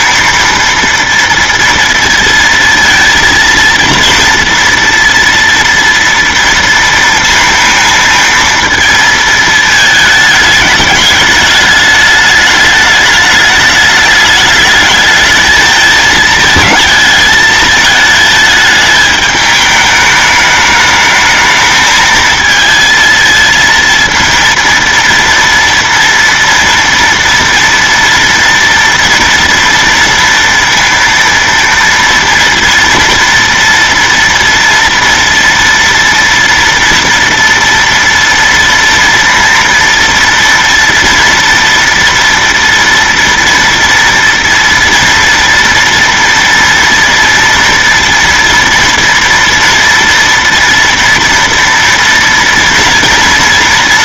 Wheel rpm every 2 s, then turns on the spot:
230, 230, 230, 230, 230, 210, 210, 210, 220, 220, 210, 220, 230, 230, 230, 230, 230, 230, 230, 230, 230, 240, 230, 230, 230, 240, 230.
none